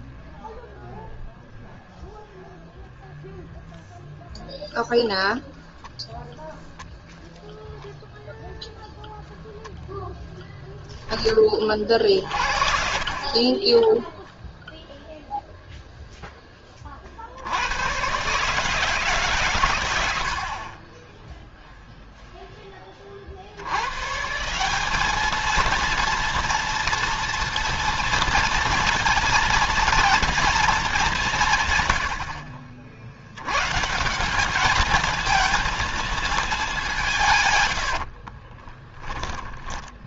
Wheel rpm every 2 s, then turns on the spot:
0, 0, 0, 0, 10, 30, 20, 0, 80, 130, 10, 70, 220, 230, 230, 160, 110, 230, 100, 20.
20-22 36-38